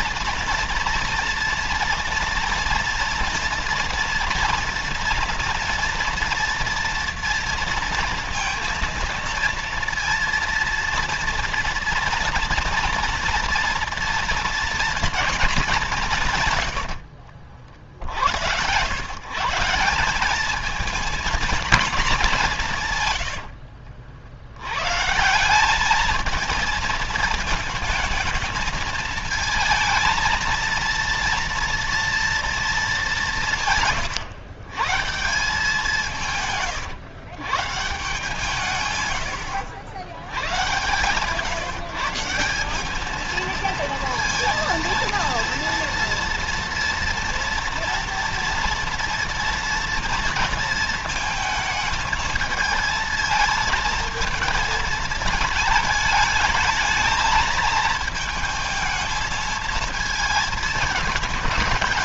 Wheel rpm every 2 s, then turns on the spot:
230, 230, 230, 230, 230, 230, 240, 240, 90, 120, 220, 130, 110, 220, 220, 230, 200, 150, 120, 120, 140, 210, 230, 230, 230, 230, 220, 220, 220, 220, 220.
16-18 22-24